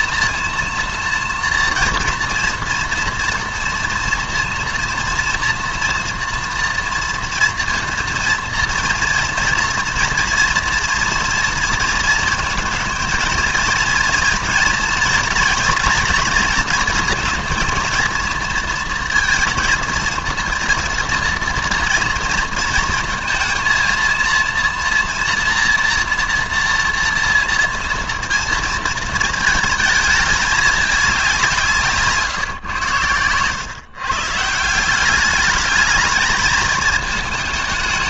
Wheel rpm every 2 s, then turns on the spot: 230, 240, 230, 240, 230, 240, 220, 230, 230, 230, 230, 230, 230, 230, 230, 210, 120, 170, 220.
none